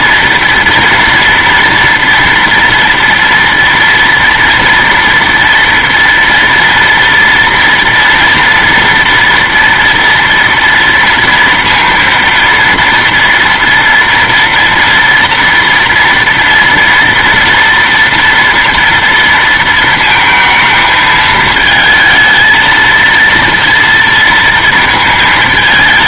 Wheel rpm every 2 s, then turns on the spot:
240, 230, 230, 230, 230, 230, 230, 230, 230, 230, 230, 230, 230.
none